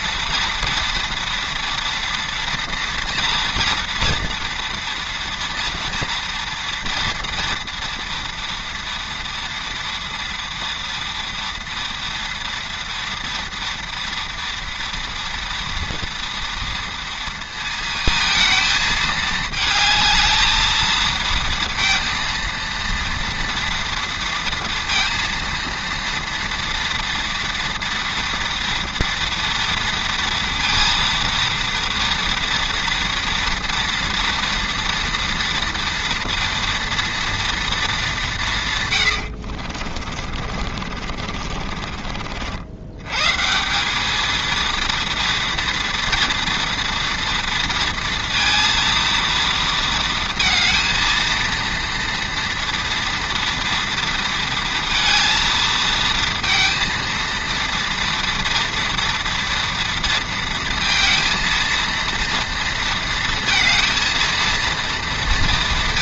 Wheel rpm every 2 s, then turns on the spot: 240, 230, 230, 230, 230, 230, 230, 230, 230, 220, 220, 230, 230, 230, 230, 230, 230, 240, 230, 160, 60, 70, 230, 230, 230, 230, 230, 230, 230, 230, 230, 230, 230.
40-42